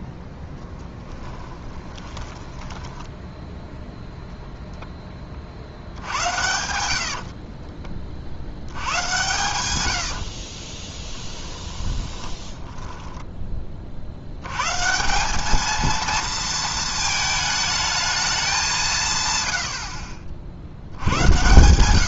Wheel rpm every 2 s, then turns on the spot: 10, 10, 0, 80, 80, 30, 10, 140, 220, 170, 60.
0-4 6-8 10-14